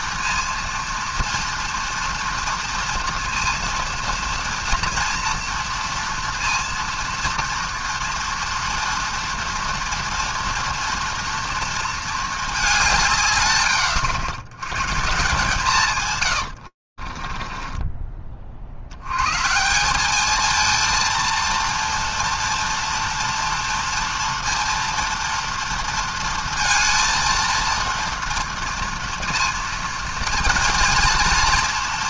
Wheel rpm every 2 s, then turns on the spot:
230, 230, 230, 230, 230, 230, 200, 110, 80, 60, 220, 240, 230, 230, 230, 230.
16-18